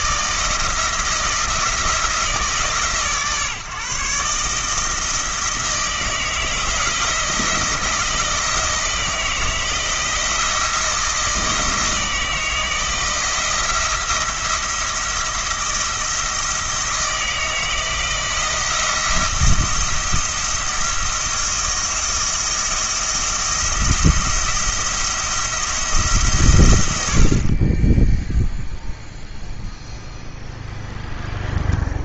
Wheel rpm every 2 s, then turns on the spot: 160, 160, 160, 160, 170, 170, 160, 170, 160, 160, 160, 170, 160, 120, 0, 0.
none